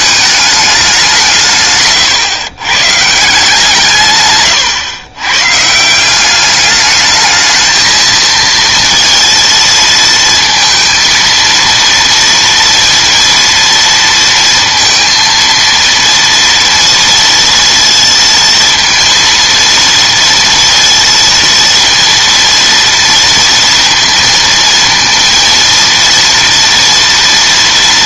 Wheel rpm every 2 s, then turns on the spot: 200, 120, 130, 210, 230, 230, 230, 230, 230, 230, 230, 230, 230, 240.
none